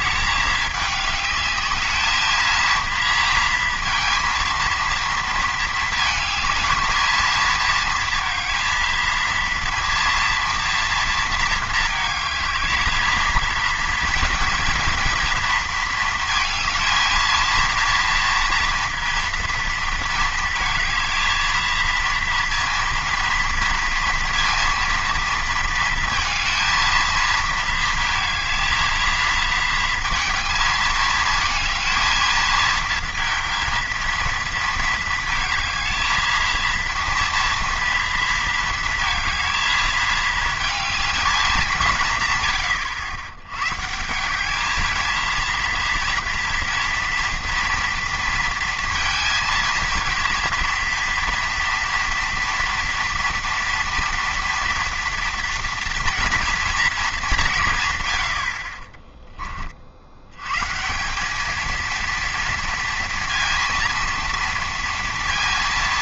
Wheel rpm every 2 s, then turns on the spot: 200, 230, 230, 220, 230, 230, 220, 230, 230, 230, 220, 230, 230, 230, 220, 220, 230, 230, 230, 230, 220, 120, 200, 230, 230, 230, 230, 230, 230, 50, 140, 230, 230.
58-60